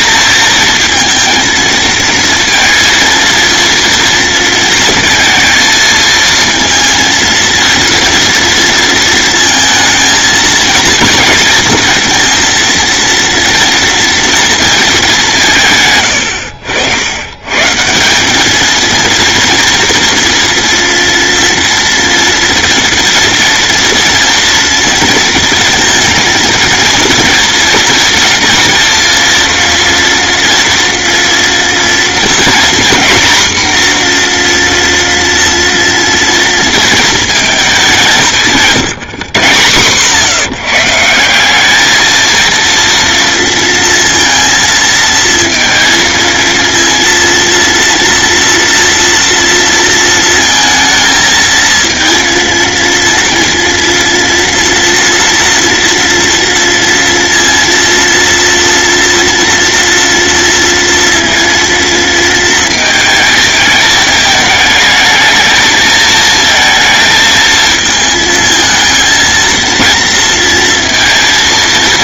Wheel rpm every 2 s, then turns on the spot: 230, 230, 230, 230, 230, 230, 230, 220, 90, 220, 230, 230, 230, 230, 240, 230, 240, 240, 230, 180, 170, 230, 230, 230, 230, 230, 230, 230, 230, 240, 230, 220, 220, 220, 220, 230.
none